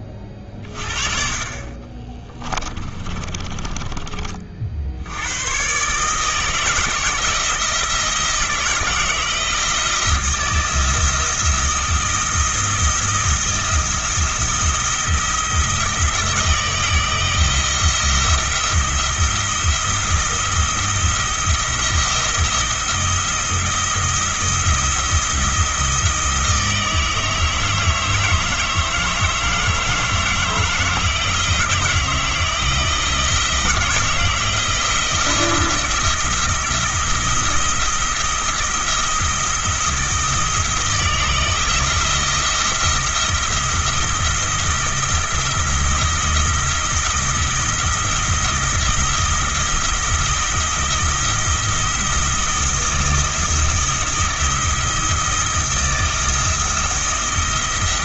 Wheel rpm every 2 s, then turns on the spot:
40, 20, 50, 160, 160, 170, 170, 170, 160, 170, 170, 170, 170, 160, 160, 160, 170, 170, 170, 170, 160, 170, 170, 160, 170, 170, 170, 170, 170.
2-4